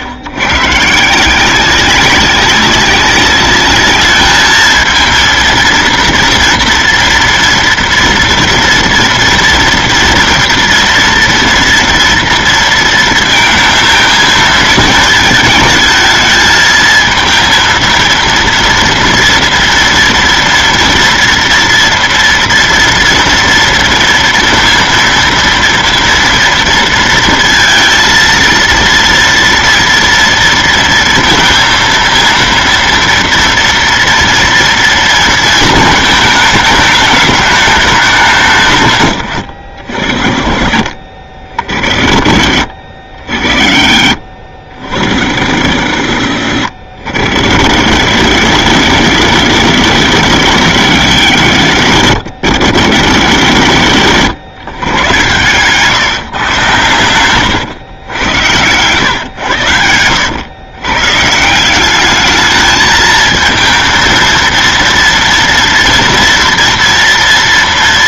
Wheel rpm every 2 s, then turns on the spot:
130, 190, 220, 230, 230, 230, 230, 220, 220, 230, 230, 230, 230, 230, 230, 230, 230, 230, 210, 140, 50, 40, 60, 60, 90, 90, 80, 110, 120, 110, 110, 220, 230, 230.
none